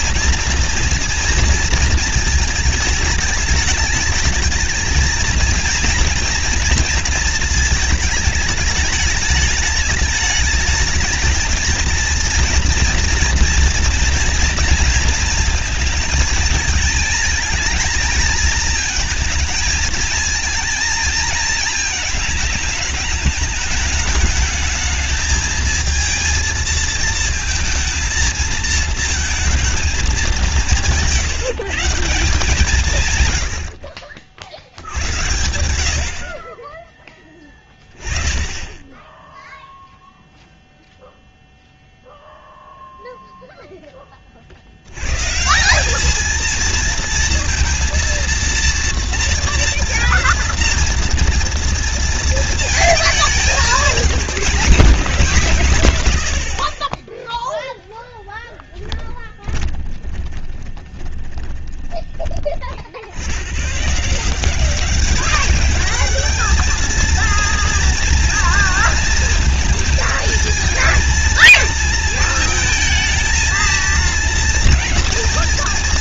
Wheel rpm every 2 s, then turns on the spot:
230, 220, 220, 230, 220, 210, 230, 230, 230, 230, 230, 210, 210, 220, 220, 200, 170, 60, 50, 20, 0, 0, 30, 220, 230, 230, 230, 210, 100, 20, 20, 30, 160, 210, 230, 230, 230, 230.
58-62